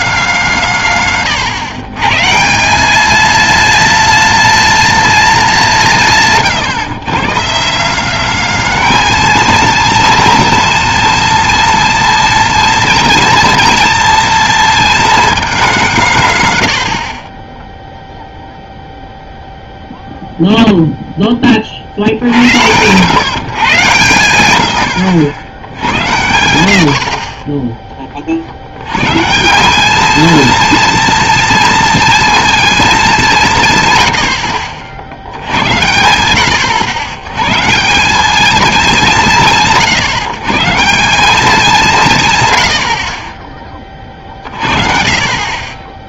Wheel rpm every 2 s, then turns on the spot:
170, 170, 210, 140, 210, 210, 210, 210, 110, 0, 0, 90, 100, 100, 80, 220, 220, 50, 80, 200, 150, 110, 40.
none